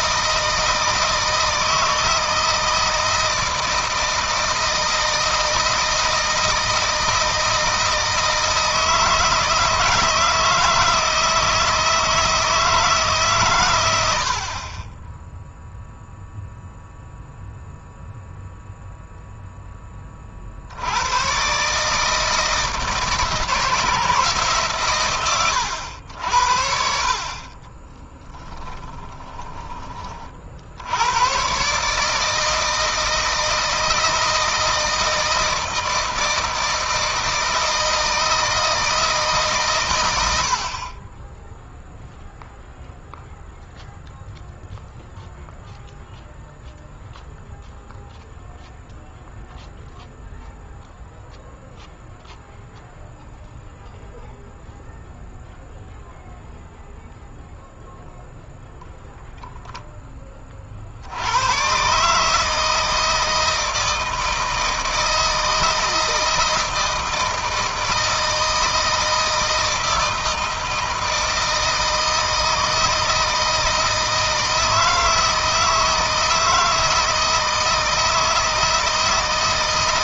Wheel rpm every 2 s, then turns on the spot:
160, 160, 160, 160, 160, 160, 150, 20, 0, 0, 80, 160, 130, 60, 10, 80, 160, 160, 160, 160, 50, 0, 0, 0, 0, 0, 0, 0, 0, 0, 50, 160, 160, 160, 160, 160, 160, 160, 160, 160.
28-30